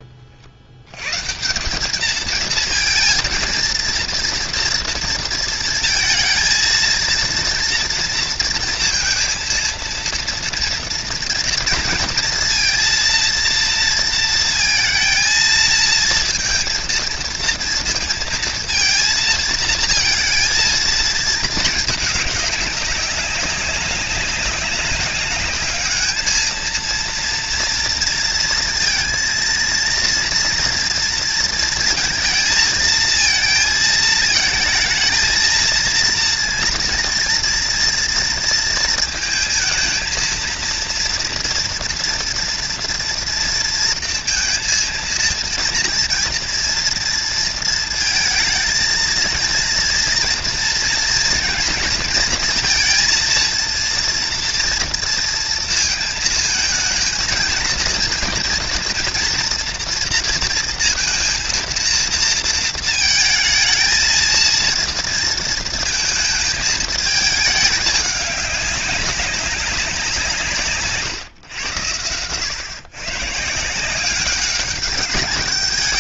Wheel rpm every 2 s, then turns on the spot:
110, 230, 230, 230, 230, 240, 230, 230, 230, 230, 230, 200, 200, 230, 230, 230, 230, 220, 230, 230, 230, 230, 230, 230, 230, 230, 230, 230, 220, 230, 230, 220, 230, 220, 200, 130, 140, 200.
none